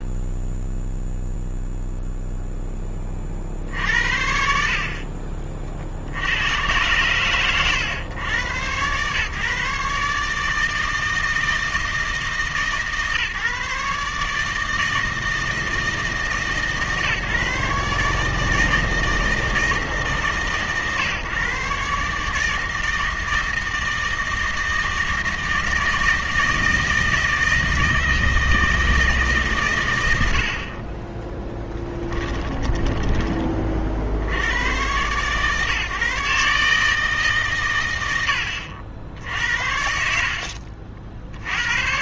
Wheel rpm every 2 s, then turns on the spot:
0, 20, 50, 110, 120, 160, 150, 160, 140, 160, 140, 160, 160, 160, 160, 40, 10, 110, 150, 60, 50.
32-34 40-42